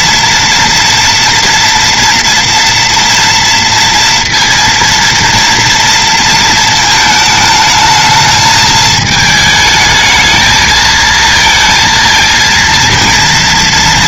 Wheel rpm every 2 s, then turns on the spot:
240, 230, 230, 220, 220, 220, 230.
none